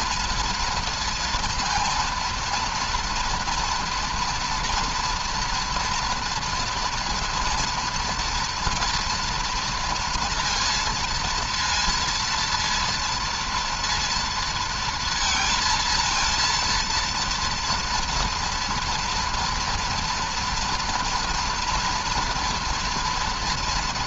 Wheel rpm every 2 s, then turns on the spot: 230, 230, 230, 240, 240, 230, 230, 230, 230, 240, 230, 230.
none